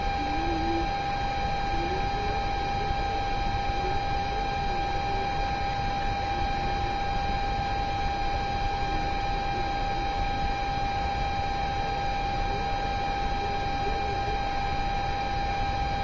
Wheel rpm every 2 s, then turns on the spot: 0, 0, 0, 0, 0, 0, 0, 0.
none